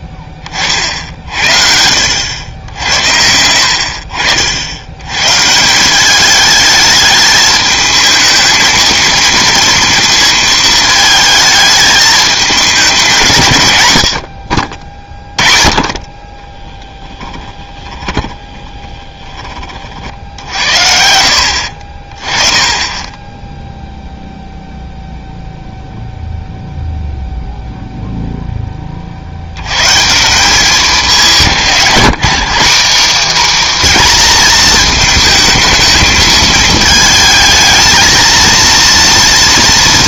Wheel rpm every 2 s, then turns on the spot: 40, 80, 70, 210, 230, 220, 210, 50, 20, 20, 70, 20, 0, 0, 10, 190, 210, 230, 220, 230.
16-20